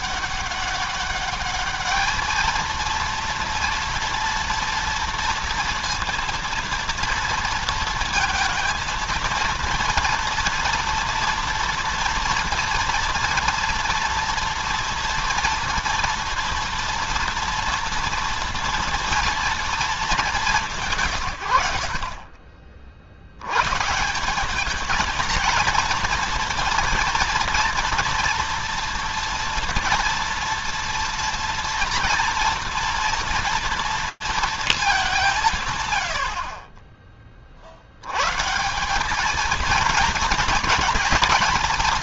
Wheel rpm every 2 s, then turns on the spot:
200, 220, 230, 230, 230, 240, 230, 230, 230, 230, 200, 40, 210, 230, 240, 240, 230, 220, 40, 150, 230.
none